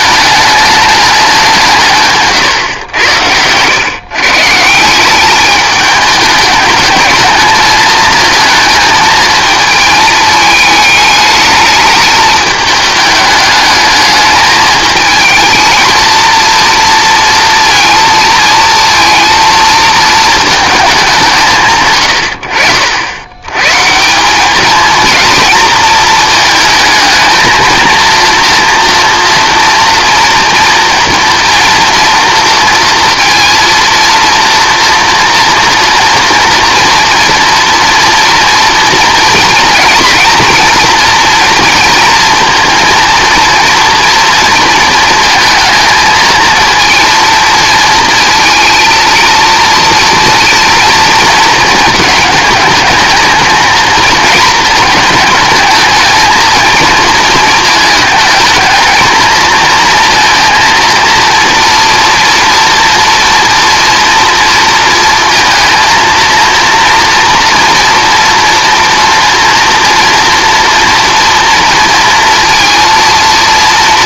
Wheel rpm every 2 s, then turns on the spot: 210, 120, 150, 210, 220, 210, 210, 220, 230, 230, 210, 70, 220, 220, 240, 230, 230, 230, 240, 230, 230, 230, 220, 230, 230, 230, 220, 220, 230, 220, 230, 230, 230, 230, 230, 230, 230.
none